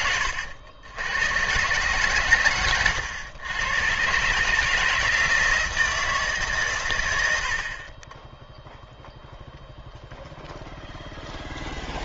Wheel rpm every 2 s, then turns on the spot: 90, 100, 160, 110, 0, 10.
none